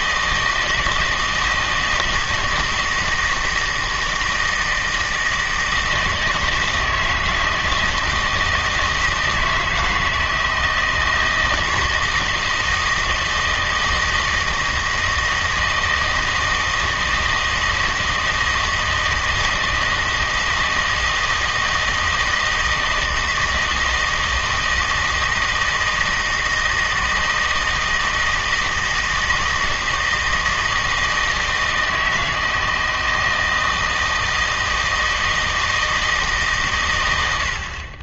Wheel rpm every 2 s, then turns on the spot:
160, 160, 160, 160, 160, 160, 160, 160, 160, 160, 160, 160, 160, 160, 160, 160, 160, 160, 130.
none